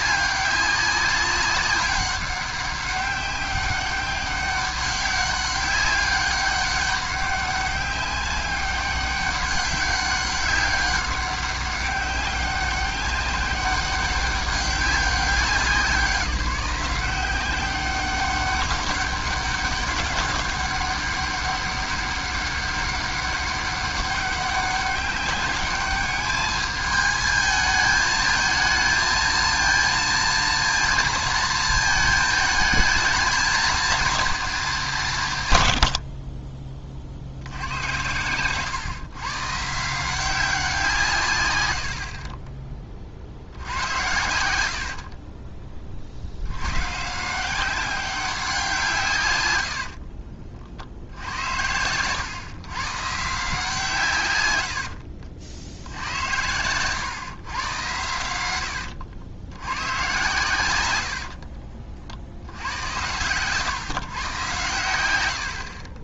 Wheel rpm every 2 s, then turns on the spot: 190, 200, 200, 200, 200, 200, 200, 200, 180, 200, 200, 200, 200, 210, 220, 230, 220, 210, 40, 130, 180, 30, 70, 100, 180, 60, 120, 100, 110, 100, 110, 80, 110.
42-46 54-56